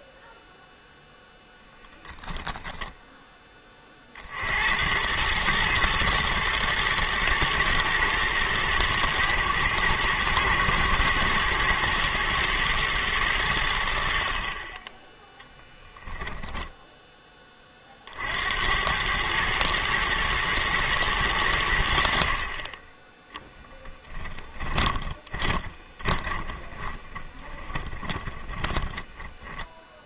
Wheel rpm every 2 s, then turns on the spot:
0, 20, 80, 120, 110, 110, 110, 30, 0, 90, 110, 30, 20, 10, 10.
2-4 24-30